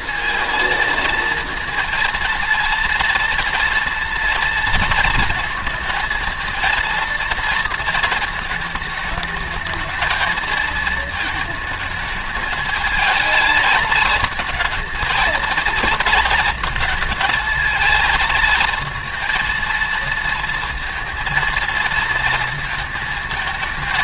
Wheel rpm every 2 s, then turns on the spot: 220, 230, 230, 230, 220, 220, 220, 220, 230, 230, 230, 220.
none